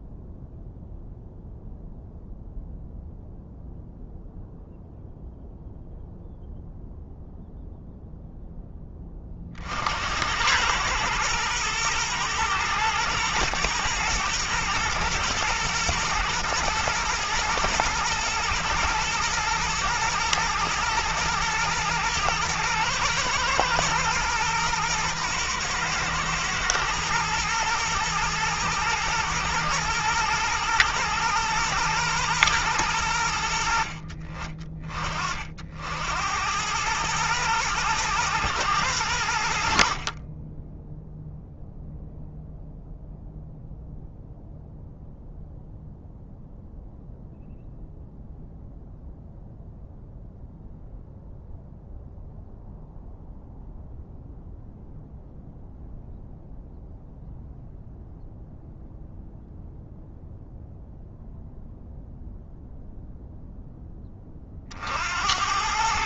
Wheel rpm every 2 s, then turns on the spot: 0, 0, 0, 0, 20, 110, 120, 120, 120, 110, 110, 120, 120, 110, 120, 120, 90, 40, 110, 90, 0, 0, 0, 0, 0, 0, 0, 0, 0, 0, 0, 0, 60.
none